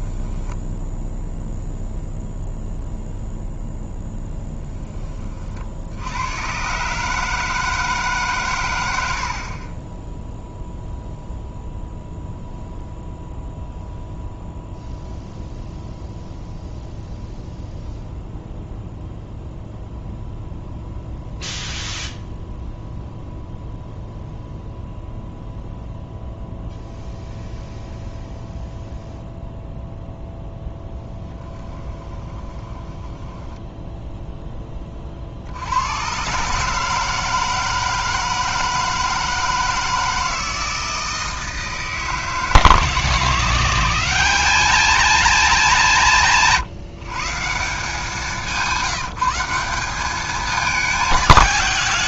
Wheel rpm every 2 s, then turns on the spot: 10, 0, 10, 120, 110, 0, 0, 0, 0, 0, 0, 0, 0, 0, 0, 10, 20, 10, 150, 160, 160, 150, 210, 160, 180, 210.
0-2 32-34